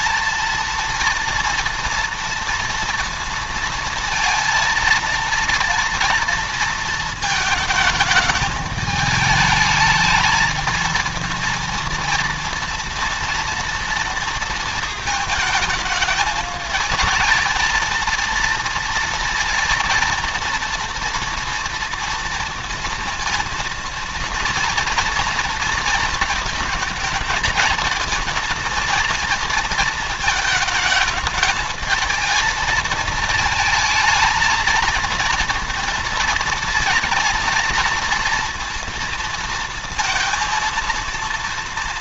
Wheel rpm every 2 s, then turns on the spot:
230, 230, 230, 230, 220, 220, 230, 220, 210, 230, 230, 230, 230, 220, 230, 220, 220, 220, 230, 230, 230.
none